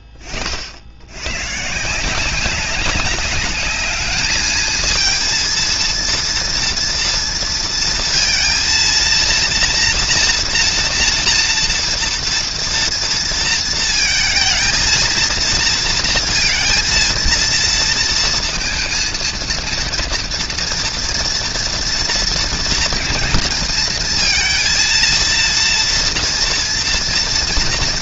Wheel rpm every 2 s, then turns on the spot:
30, 190, 210, 230, 230, 240, 230, 230, 230, 230, 230, 230, 230, 230.
none